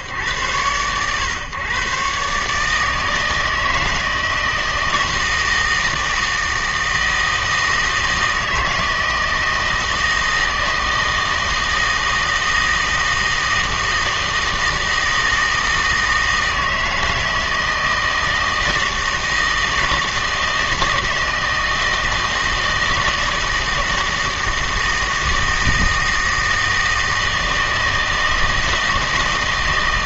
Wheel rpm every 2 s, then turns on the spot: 120, 160, 160, 160, 160, 160, 160, 160, 160, 160, 160, 160, 160, 160, 160.
none